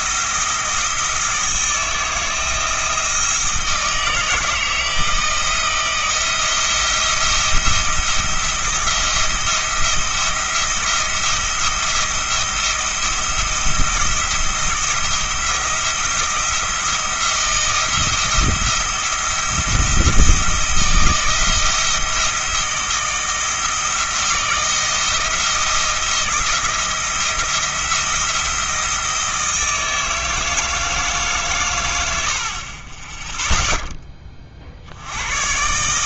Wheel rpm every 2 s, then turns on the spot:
170, 160, 160, 170, 170, 170, 170, 170, 170, 170, 170, 170, 170, 170, 170, 160, 30, 70.
none